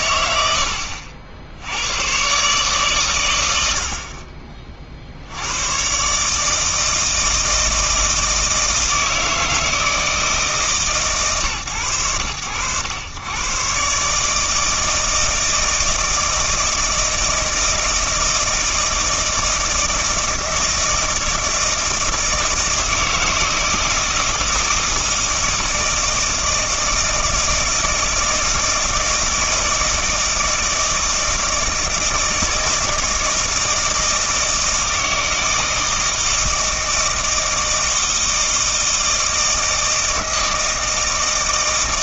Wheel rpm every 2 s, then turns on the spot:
70, 140, 40, 160, 160, 150, 100, 160, 160, 160, 160, 160, 160, 160, 160, 160, 160, 160, 160, 160, 160.
none